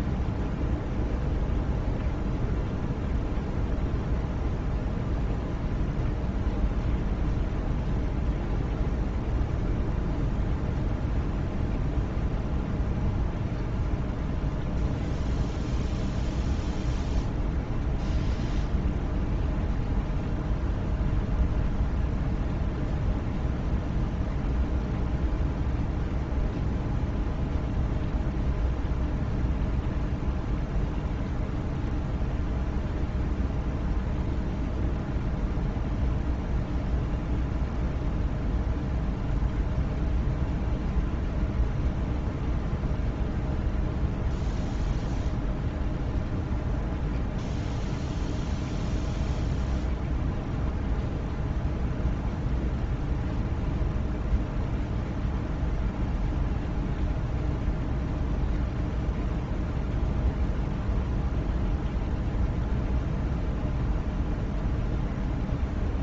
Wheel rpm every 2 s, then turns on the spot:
0, 0, 0, 0, 0, 0, 0, 0, 0, 0, 0, 0, 0, 0, 0, 0, 0, 0, 0, 0, 0, 0, 0, 0, 0, 0, 0, 0, 0, 0, 0, 0, 0.
none